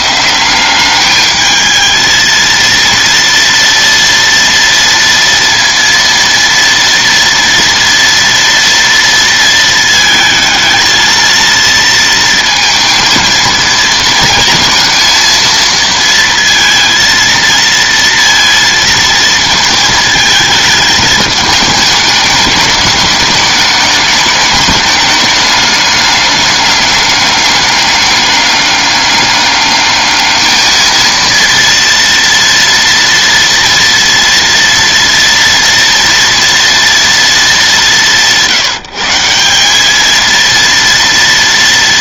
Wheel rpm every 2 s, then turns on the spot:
190, 230, 230, 230, 230, 220, 230, 230, 230, 230, 220, 210, 210, 200, 200, 220, 230, 230, 230, 160, 230.
none